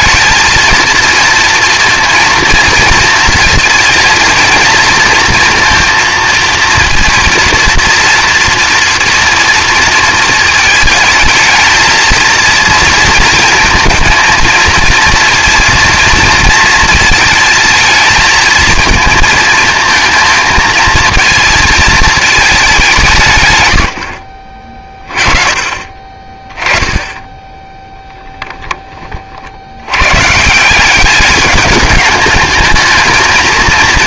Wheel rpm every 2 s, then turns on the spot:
220, 230, 230, 230, 230, 220, 230, 230, 230, 220, 230, 200, 40, 10, 10, 170, 210.
none